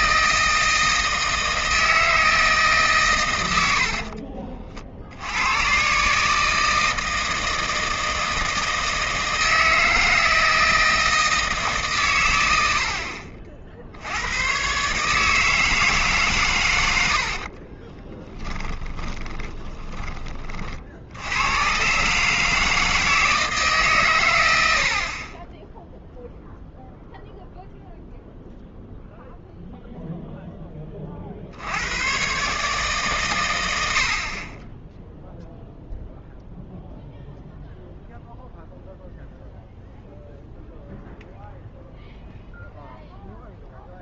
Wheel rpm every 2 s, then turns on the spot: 160, 160, 50, 150, 160, 160, 90, 110, 120, 10, 40, 160, 90, 0, 0, 10, 140, 30, 0, 0, 0, 0.
18-20